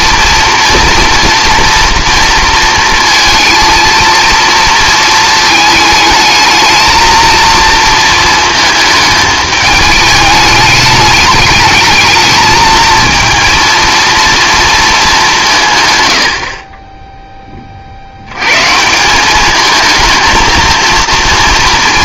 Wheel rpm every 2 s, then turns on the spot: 230, 230, 230, 220, 220, 210, 220, 220, 40, 150, 230.
none